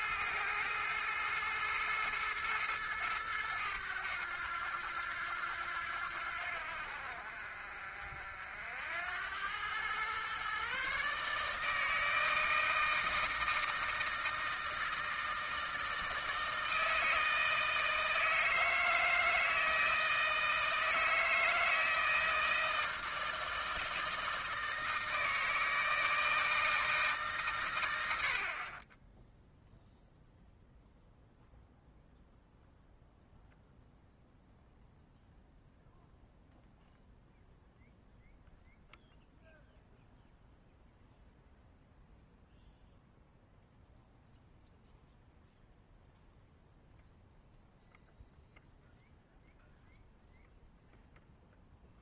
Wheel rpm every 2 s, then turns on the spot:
110, 110, 90, 70, 70, 130, 160, 160, 160, 160, 160, 160, 160, 160, 50, 0, 0, 0, 0, 0, 0, 0, 0, 0, 0, 0.
none